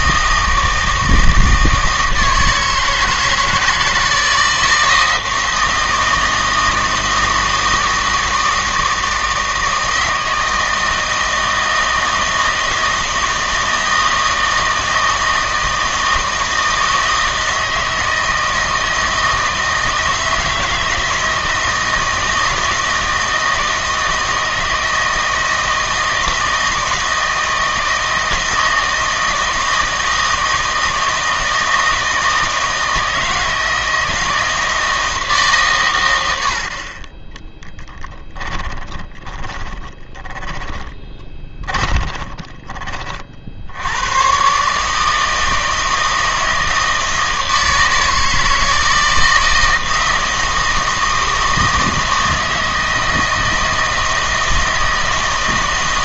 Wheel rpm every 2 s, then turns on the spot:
160, 160, 160, 160, 160, 160, 160, 160, 160, 160, 160, 160, 160, 160, 160, 160, 160, 160, 50, 20, 10, 30, 150, 160, 160, 160, 160, 160.
38-42